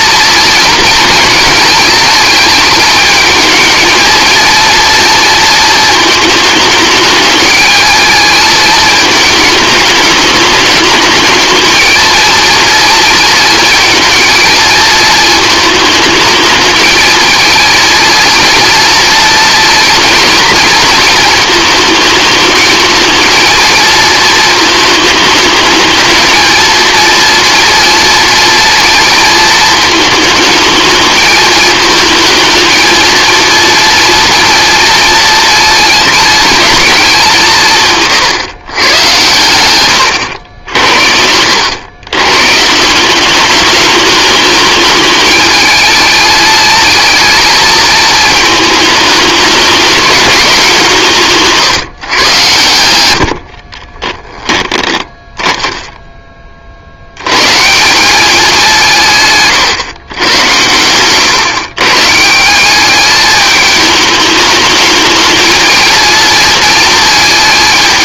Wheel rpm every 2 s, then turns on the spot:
230, 210, 230, 210, 220, 210, 230, 230, 210, 230, 220, 220, 220, 230, 230, 220, 230, 230, 220, 110, 80, 160, 210, 220, 210, 190, 100, 20, 50, 180, 100, 180, 210, 230.
60-62